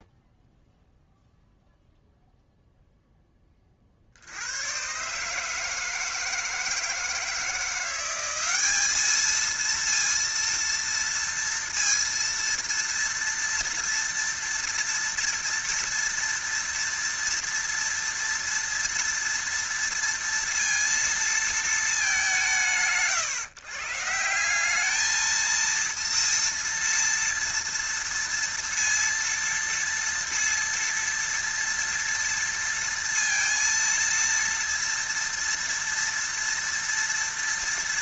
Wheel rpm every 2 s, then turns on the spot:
0, 0, 120, 160, 200, 230, 230, 230, 230, 230, 230, 120, 210, 230, 230, 230, 230, 240, 230.
none